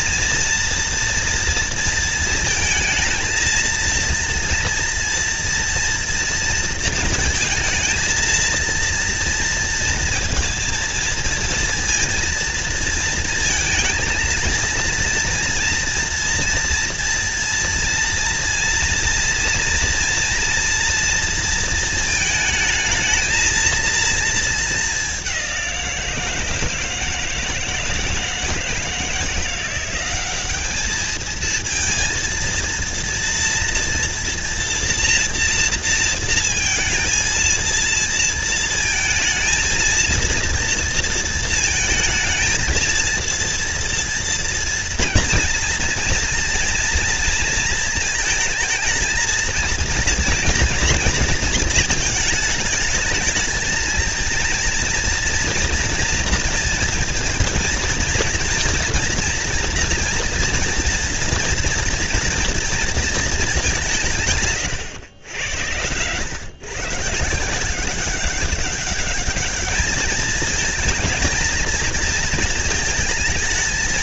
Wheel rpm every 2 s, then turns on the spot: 230, 230, 230, 230, 230, 230, 230, 230, 230, 230, 230, 220, 220, 160, 170, 200, 230, 230, 220, 230, 230, 230, 230, 230, 230, 240, 220, 230, 230, 240, 230, 230, 140, 120, 200, 220, 220.
none